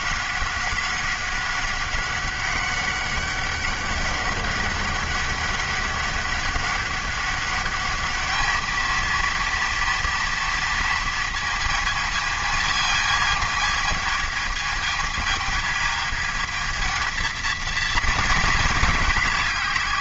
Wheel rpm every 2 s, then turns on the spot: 190, 190, 200, 200, 220, 230, 220, 220, 220, 220.
none